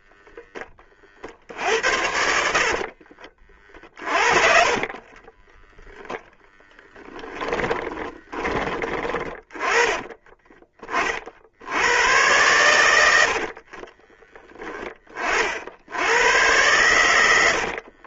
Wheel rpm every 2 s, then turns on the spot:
40, 40, 40, 10, 20, 30, 80, 20, 100.
2-8